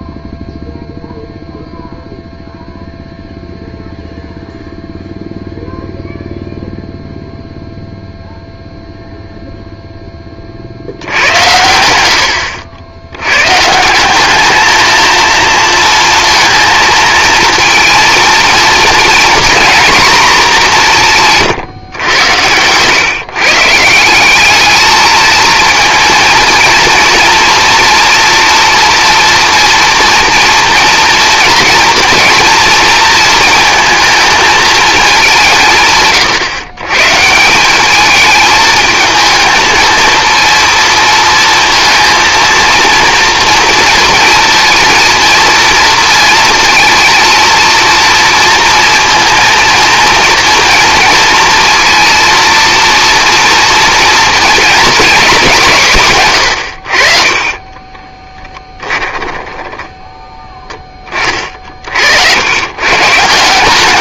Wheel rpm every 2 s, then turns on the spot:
0, 0, 0, 0, 0, 60, 80, 210, 220, 230, 200, 110, 210, 230, 230, 230, 230, 220, 130, 220, 230, 230, 230, 230, 230, 230, 230, 240, 90, 10, 20, 120.
56-60